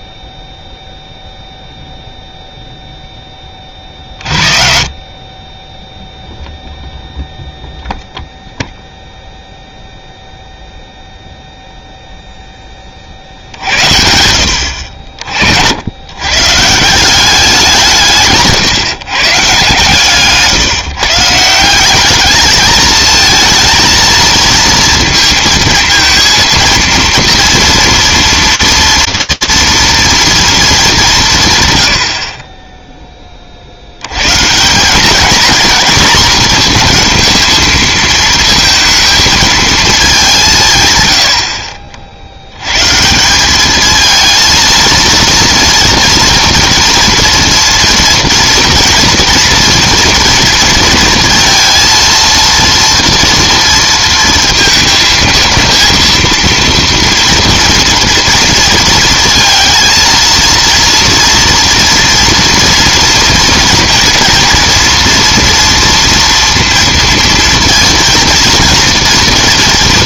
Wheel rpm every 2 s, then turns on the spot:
0, 0, 50, 0, 0, 0, 20, 70, 140, 150, 150, 220, 230, 230, 230, 210, 20, 180, 230, 230, 150, 110, 230, 230, 240, 230, 230, 230, 230, 230, 230, 230, 240, 230, 230.
none